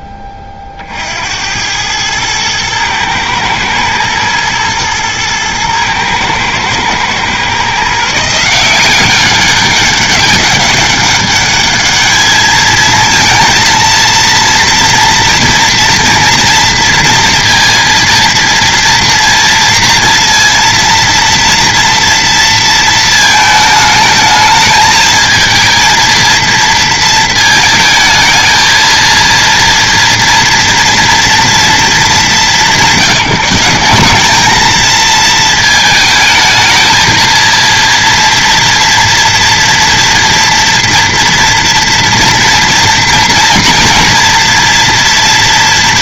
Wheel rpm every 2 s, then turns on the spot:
40, 110, 120, 110, 170, 200, 220, 230, 230, 230, 230, 230, 220, 230, 220, 230, 190, 220, 220, 230, 230, 230, 230.
none